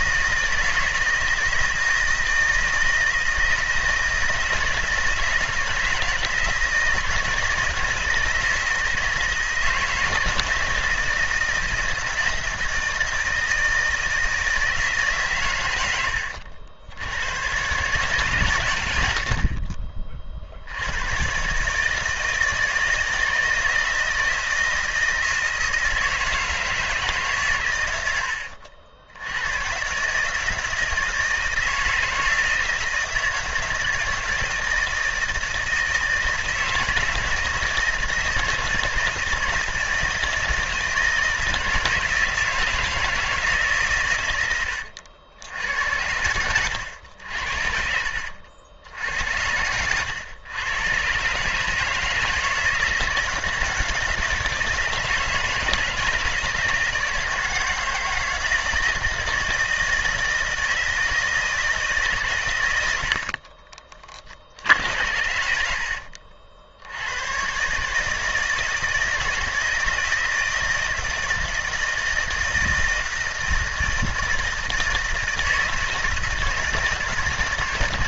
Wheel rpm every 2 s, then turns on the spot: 160, 160, 160, 160, 160, 160, 160, 160, 70, 110, 70, 160, 160, 160, 80, 160, 160, 160, 160, 160, 160, 160, 90, 90, 80, 110, 160, 160, 160, 170, 160, 110, 70, 70, 160, 160, 170, 160, 160.
44-48